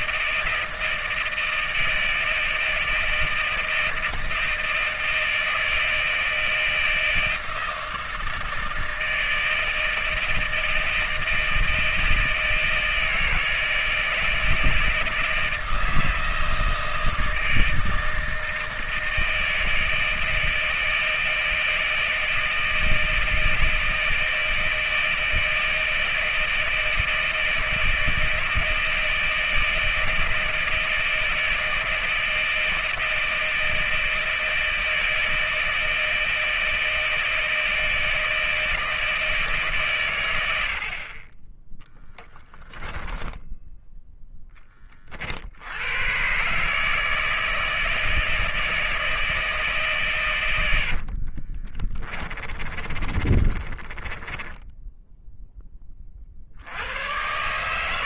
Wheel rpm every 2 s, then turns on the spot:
160, 160, 160, 160, 160, 160, 160, 160, 160, 160, 160, 160, 160, 160, 160, 160, 160, 160, 160, 160, 50, 20, 40, 160, 160, 60, 30, 10, 90.
42-44 50-56